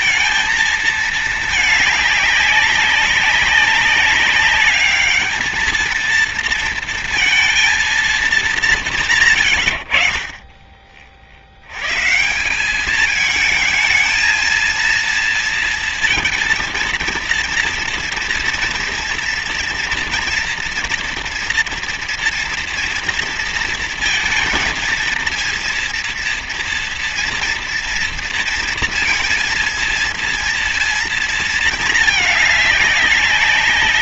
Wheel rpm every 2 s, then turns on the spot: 220, 200, 210, 230, 180, 30, 190, 230, 230, 230, 230, 230, 220, 230, 230, 230, 200.
none